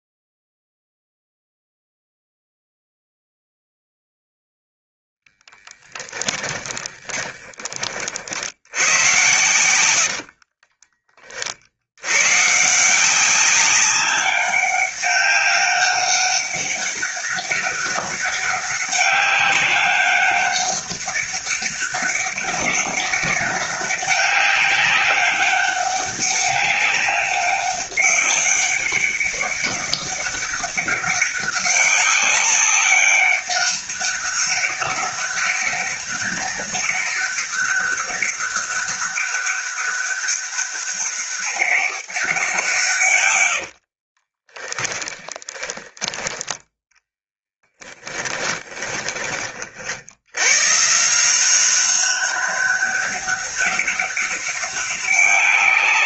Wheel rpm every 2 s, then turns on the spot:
0, 0, 0, 20, 100, 30, 170, 200, 200, 200, 200, 200, 200, 200, 200, 200, 200, 200, 200, 200, 200, 140, 10, 10, 20, 150, 200, 200.
6-10 44-46 48-50